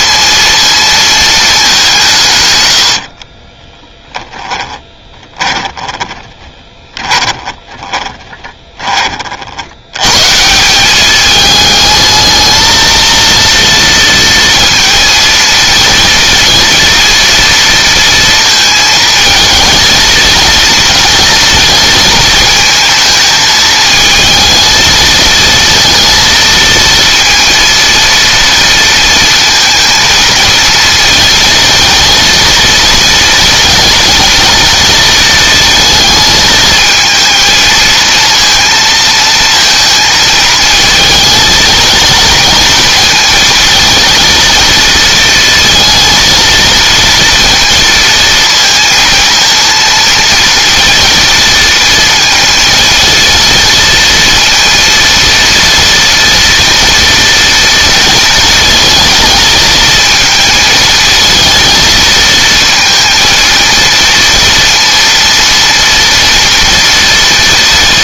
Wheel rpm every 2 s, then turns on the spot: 230, 80, 20, 30, 30, 200, 230, 230, 230, 230, 230, 220, 220, 230, 230, 230, 230, 230, 220, 230, 220, 230, 230, 230, 230, 230, 220, 230, 230, 220, 220, 230, 230, 230.
2-8